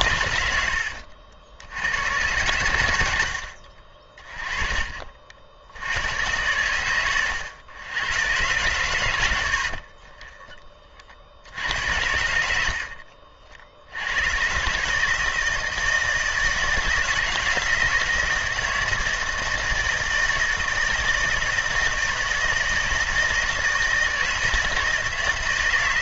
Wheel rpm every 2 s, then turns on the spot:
90, 90, 30, 110, 110, 30, 70, 150, 160, 170, 160, 170, 160.
0-2